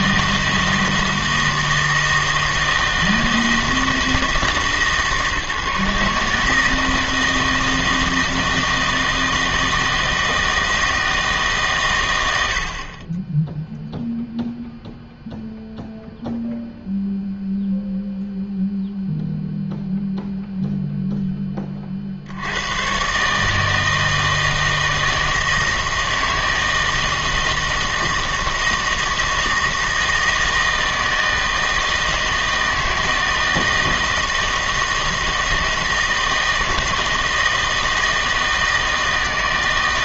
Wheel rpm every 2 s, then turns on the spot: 160, 160, 150, 160, 160, 160, 70, 0, 0, 0, 0, 90, 160, 160, 160, 160, 160, 160, 160, 160.
none